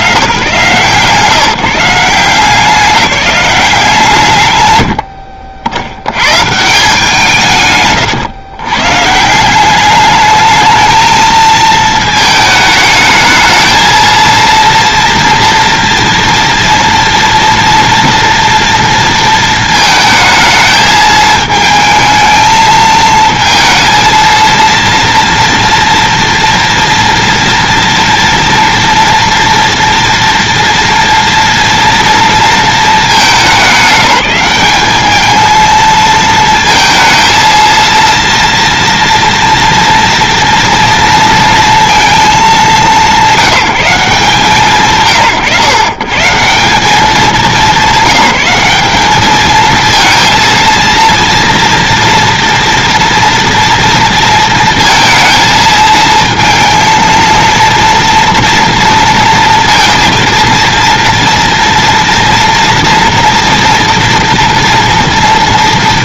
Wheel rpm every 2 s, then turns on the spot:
130, 190, 70, 160, 130, 220, 210, 230, 230, 230, 220, 220, 230, 240, 230, 230, 220, 200, 230, 230, 230, 200, 140, 190, 190, 230, 230, 230, 230, 230, 230, 230, 230.
none